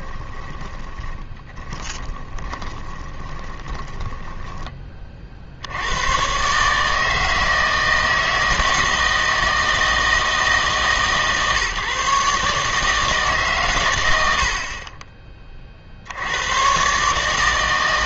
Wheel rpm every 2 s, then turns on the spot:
30, 20, 20, 150, 160, 160, 150, 50, 120.
0-4